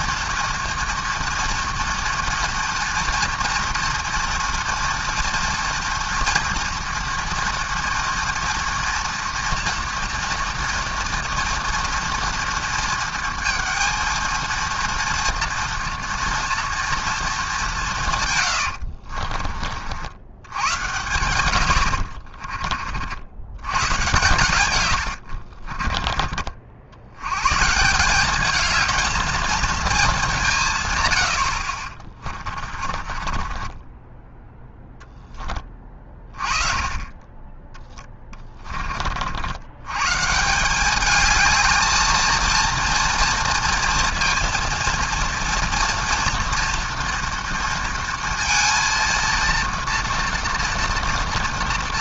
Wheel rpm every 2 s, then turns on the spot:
230, 230, 230, 240, 240, 240, 230, 230, 230, 80, 120, 50, 110, 70, 220, 140, 30, 10, 30, 40, 190, 230, 230, 230, 230, 230.
18-20 24-26 32-34 38-40